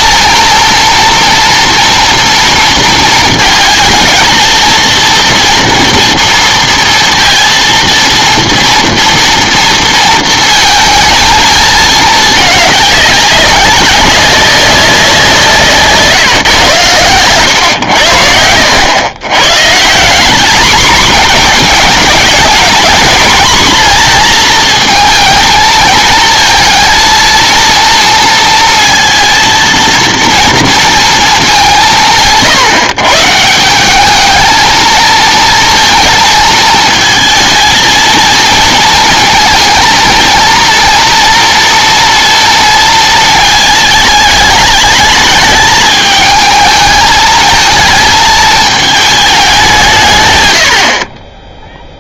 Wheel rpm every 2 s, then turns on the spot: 230, 230, 230, 230, 240, 230, 210, 190, 130, 90, 220, 230, 230, 230, 230, 230, 160, 220, 220, 230, 230, 230, 220, 220, 220, 80.
none